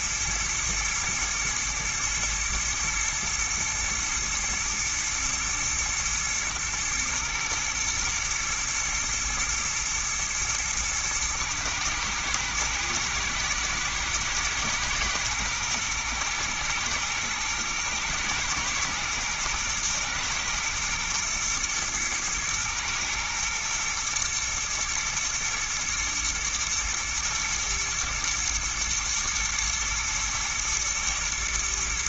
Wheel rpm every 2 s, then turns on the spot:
110, 110, 110, 110, 110, 110, 120, 120, 110, 110, 120, 110, 110, 120, 120, 110.
none